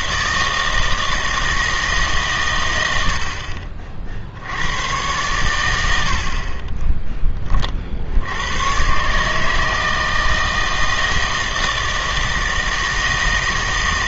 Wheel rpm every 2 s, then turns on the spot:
160, 110, 100, 30, 110, 160, 160.
none